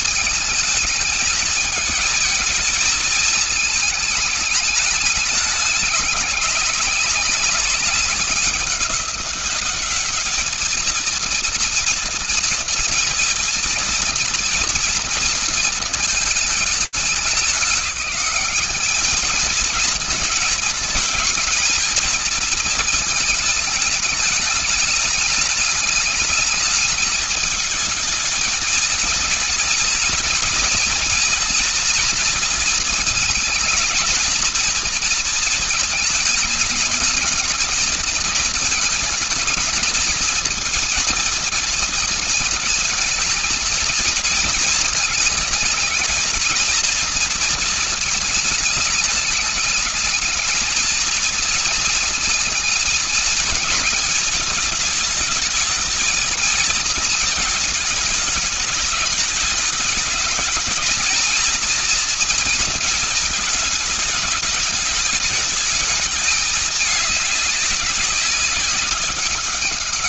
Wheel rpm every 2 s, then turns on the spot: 210, 220, 210, 200, 200, 220, 230, 230, 210, 200, 220, 230, 210, 210, 220, 230, 230, 230, 210, 220, 220, 220, 230, 220, 210, 220, 220, 210, 220, 220, 220, 230, 210, 210, 200.
none